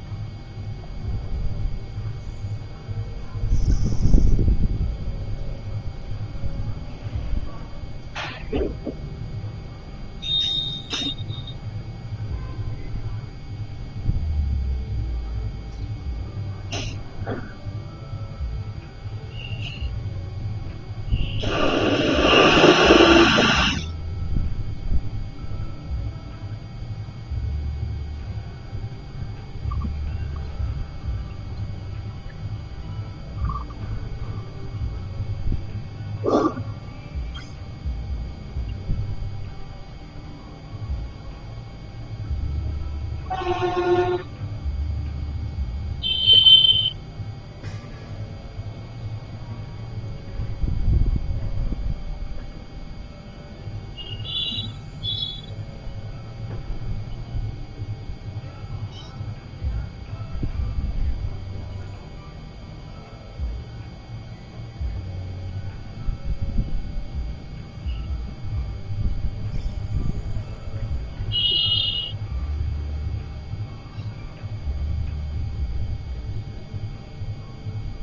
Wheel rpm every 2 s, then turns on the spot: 0, 0, 0, 0, 0, 0, 0, 0, 0, 0, 0, 0, 0, 0, 0, 0, 0, 0, 0, 0, 0, 0, 0, 0, 0, 0, 0, 0, 0, 0, 0, 0, 0, 0, 0, 0, 0, 0, 0.
none